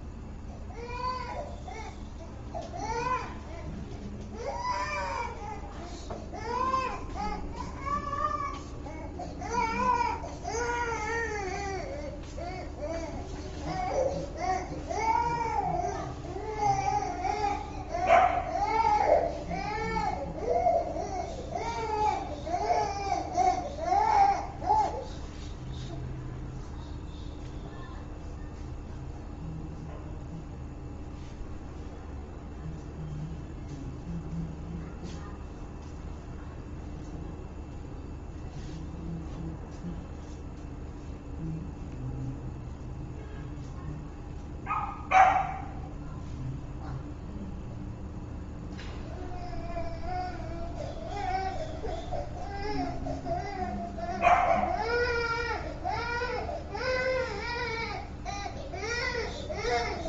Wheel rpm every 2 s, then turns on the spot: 0, 0, 0, 0, 0, 0, 0, 0, 0, 0, 0, 0, 0, 0, 0, 0, 0, 0, 0, 0, 0, 0, 0, 0, 0, 0, 0, 0, 0, 0.
none